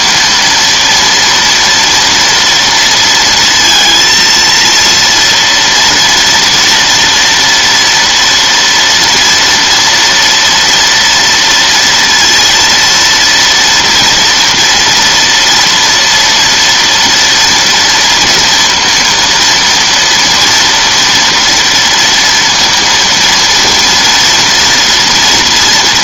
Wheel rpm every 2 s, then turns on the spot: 230, 230, 230, 240, 230, 230, 230, 230, 230, 230, 230, 230, 230.
none